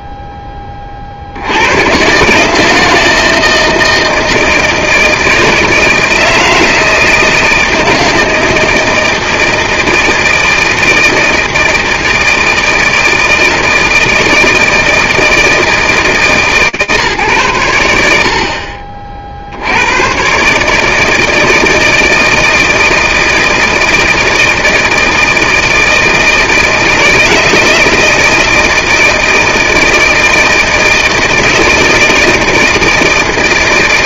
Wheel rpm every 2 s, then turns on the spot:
20, 160, 160, 160, 160, 160, 160, 160, 150, 40, 150, 160, 160, 160, 160, 160, 170.
none